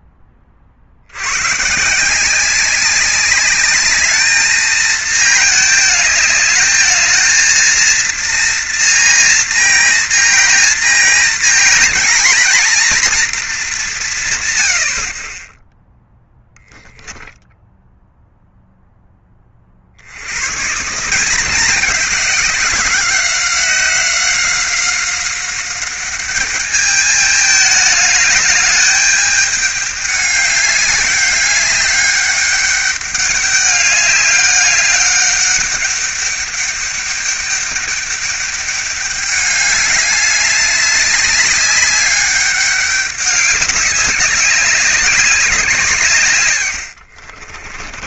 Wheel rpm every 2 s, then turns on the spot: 60, 190, 220, 220, 230, 230, 230, 80, 10, 0, 150, 190, 190, 210, 210, 200, 200, 200, 200, 210, 200, 200, 200, 90.
46-48